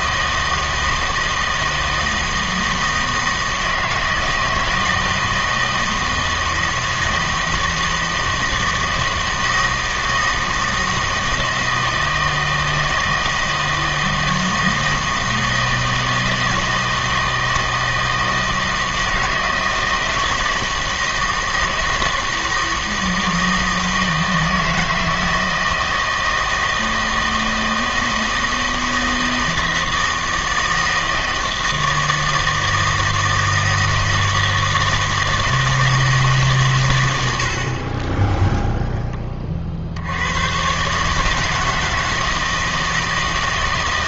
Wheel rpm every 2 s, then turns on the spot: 160, 160, 160, 160, 160, 160, 160, 160, 160, 160, 160, 160, 160, 160, 160, 160, 160, 160, 130, 0, 120, 160.
none